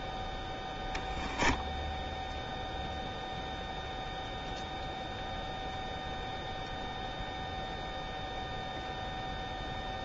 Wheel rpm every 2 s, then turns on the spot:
0, 0, 0, 0, 0.
none